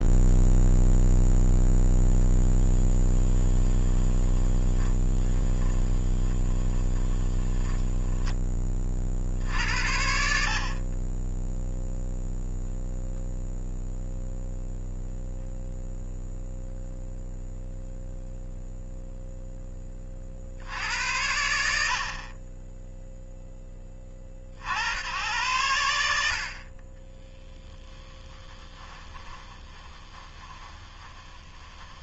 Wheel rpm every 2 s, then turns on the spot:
0, 10, 20, 20, 30, 50, 0, 0, 0, 0, 70, 10, 70, 40, 10, 20.
2-8 28-32